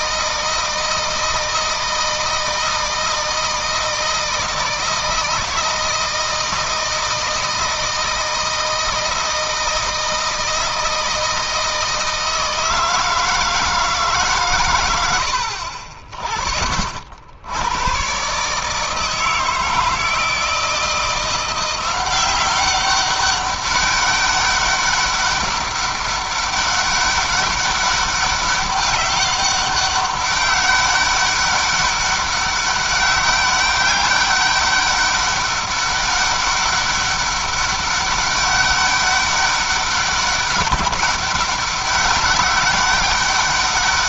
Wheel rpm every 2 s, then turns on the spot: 160, 160, 160, 160, 160, 160, 160, 120, 60, 150, 160, 190, 200, 200, 200, 200, 200, 200, 200, 200, 200, 200.
none